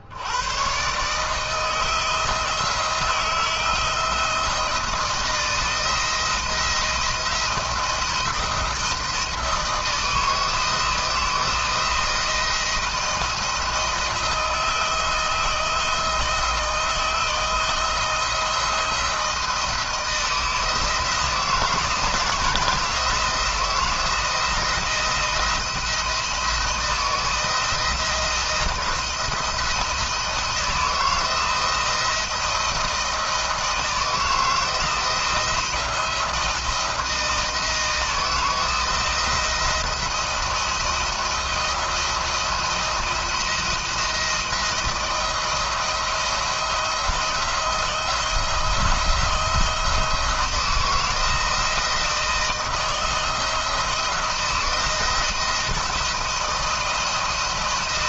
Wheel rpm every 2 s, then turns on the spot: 120, 170, 170, 170, 170, 160, 170, 170, 160, 170, 160, 160, 170, 160, 160, 160, 170, 170, 170, 160, 170, 170, 160, 160, 170, 160, 160, 170, 170.
none